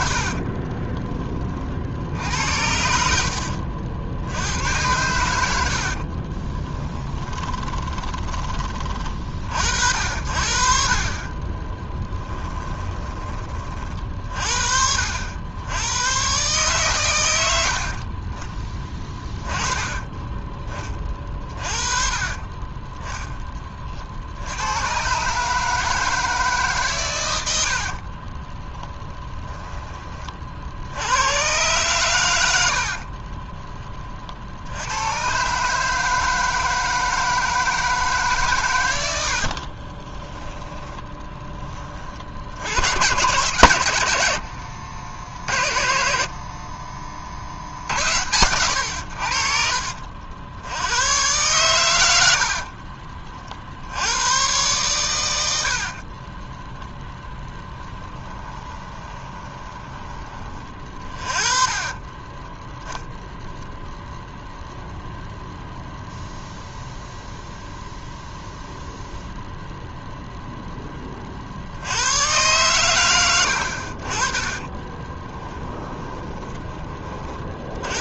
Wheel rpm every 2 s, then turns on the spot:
40, 70, 90, 20, 30, 50, 20, 50, 130, 20, 20, 20, 90, 150, 20, 50, 70, 80, 160, 120, 10, 70, 70, 30, 90, 80, 50, 120, 20, 20, 30, 10, 0, 0, 0, 10, 110, 20, 20.
0-4 6-8 12-14 28-30 32-34 40-42 56-62 74-76